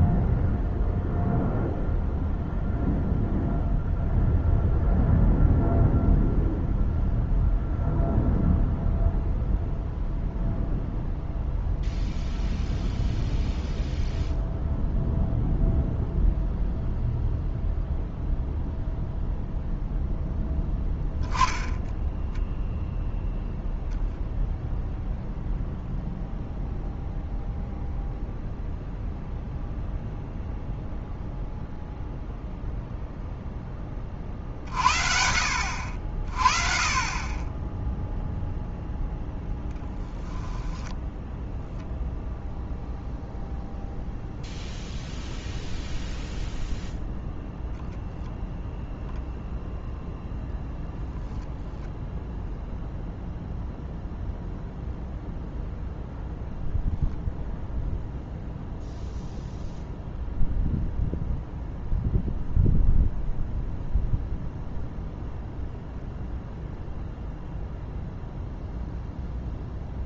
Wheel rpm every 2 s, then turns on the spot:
0, 0, 0, 0, 0, 0, 0, 0, 0, 0, 10, 0, 0, 0, 0, 0, 0, 60, 40, 0, 10, 0, 0, 0, 0, 0, 0, 0, 0, 0, 0, 0, 0, 0, 0.
40-42